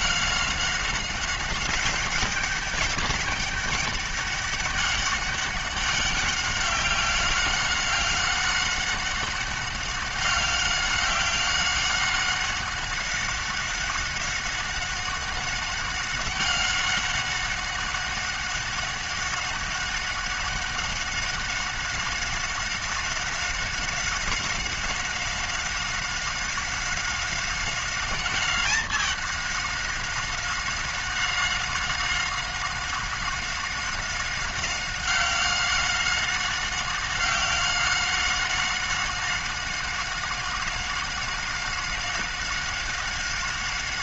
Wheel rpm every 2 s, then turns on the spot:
190, 200, 200, 190, 190, 190, 190, 190, 190, 190, 190, 190, 190, 190, 200, 190, 190, 190, 190, 190, 190, 190.
none